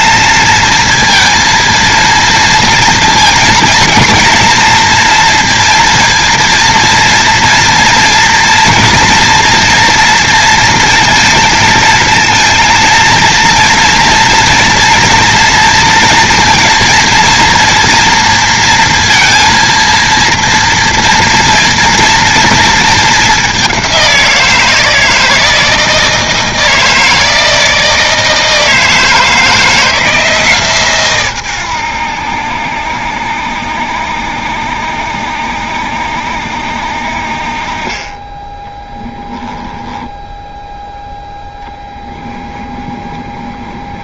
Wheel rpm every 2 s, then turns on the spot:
230, 230, 240, 230, 230, 230, 230, 230, 230, 230, 230, 220, 160, 160, 160, 140, 70, 70, 60, 10, 0, 20.
38-40 42-44